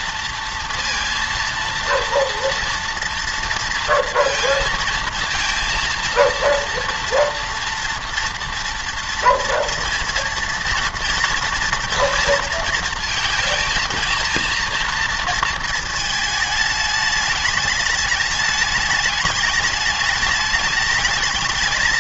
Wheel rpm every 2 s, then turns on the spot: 230, 230, 230, 230, 230, 230, 230, 230, 210, 210, 210.
none